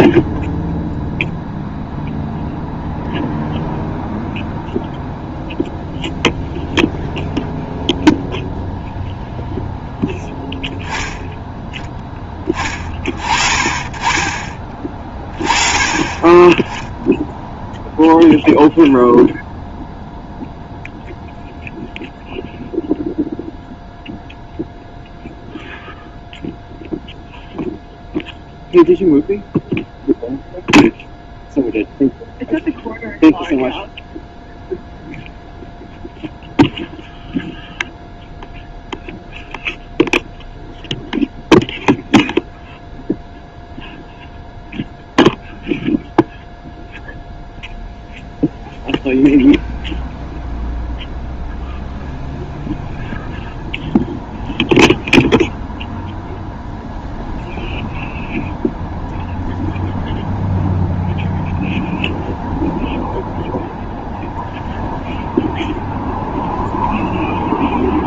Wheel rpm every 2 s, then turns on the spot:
0, 0, 0, 0, 0, 0, 20, 20, 10, 0, 0, 0, 0, 0, 0, 0, 0, 0, 0, 0, 0, 0, 0, 0, 0, 0, 0, 0, 0, 0, 0, 0, 0, 0.
none